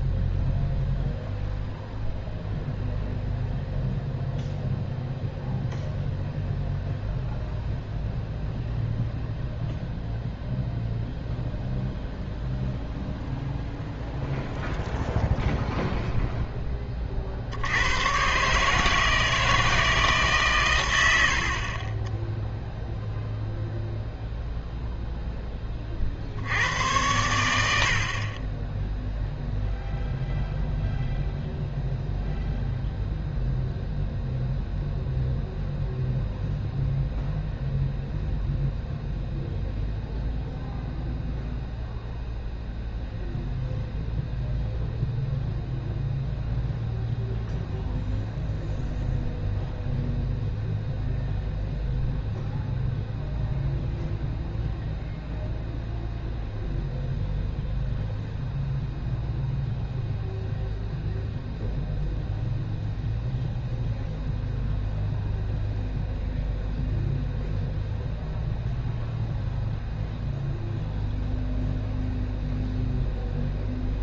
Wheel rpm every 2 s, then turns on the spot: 0, 0, 0, 0, 0, 0, 0, 0, 10, 140, 130, 0, 0, 80, 10, 0, 0, 0, 0, 0, 0, 0, 0, 0, 0, 0, 0, 0, 0, 0, 0, 0, 0, 0, 0, 0, 0.
none